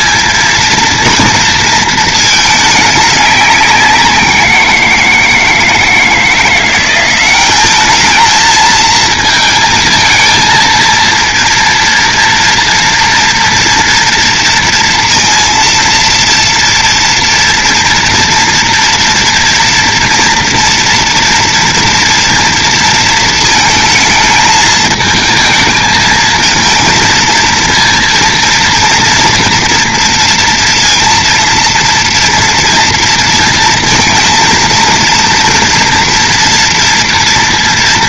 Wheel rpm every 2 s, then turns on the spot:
230, 210, 170, 180, 220, 230, 230, 230, 230, 230, 230, 230, 220, 230, 230, 230, 230, 230, 230.
none